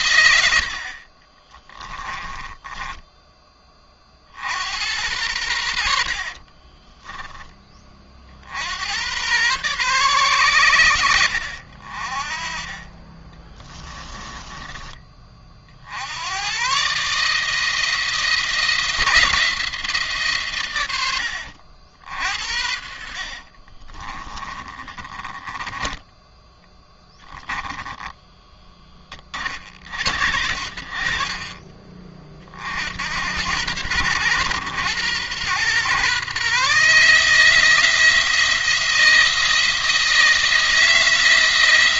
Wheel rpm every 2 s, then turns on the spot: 50, 10, 80, 30, 90, 100, 30, 20, 130, 170, 110, 50, 20, 10, 20, 60, 60, 110, 140, 170, 160.
6-8 12-14 22-26